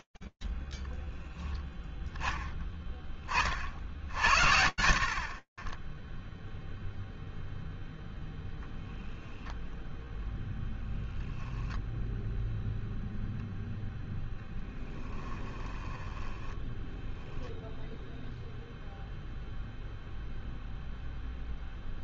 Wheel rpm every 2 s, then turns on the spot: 80, 0, 80, 10, 0, 0, 0, 10, 10, 0, 0.
14-18